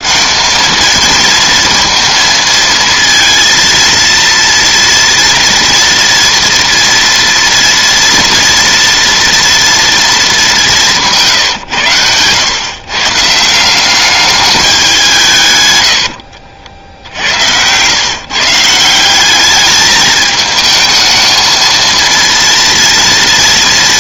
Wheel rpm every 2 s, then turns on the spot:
220, 230, 230, 230, 230, 180, 120, 200, 60, 150, 220, 230.
16-18